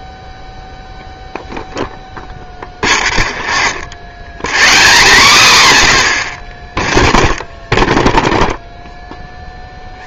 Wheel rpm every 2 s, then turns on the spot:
0, 0, 0, 0, 0.
none